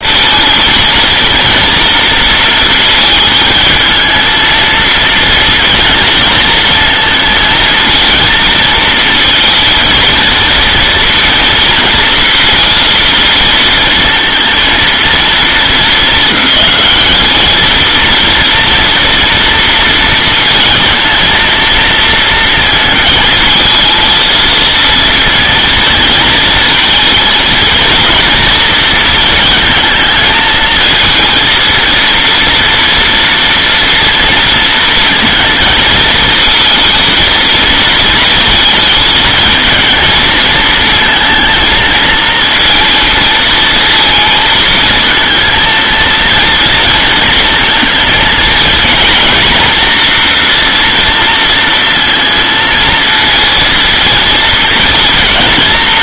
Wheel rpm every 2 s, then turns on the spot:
220, 220, 220, 220, 230, 230, 230, 230, 220, 230, 230, 220, 230, 220, 230, 220, 230, 230, 230, 230, 220, 230, 230, 230, 220, 230, 230, 220.
none